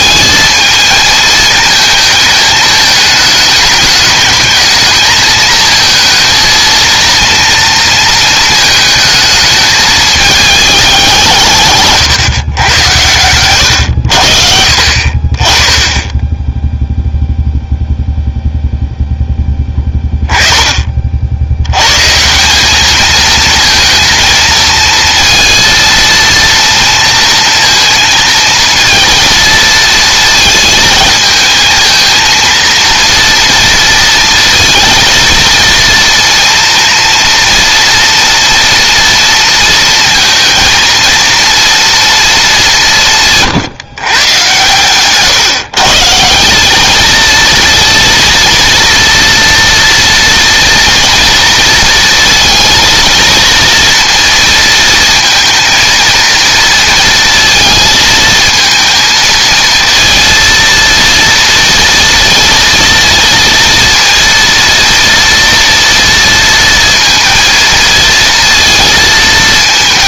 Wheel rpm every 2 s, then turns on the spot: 220, 220, 220, 230, 220, 200, 110, 50, 0, 0, 20, 190, 230, 230, 230, 220, 230, 230, 230, 230, 230, 210, 130, 200, 230, 230, 230, 230, 230, 230, 230, 230, 230, 230, 230.
none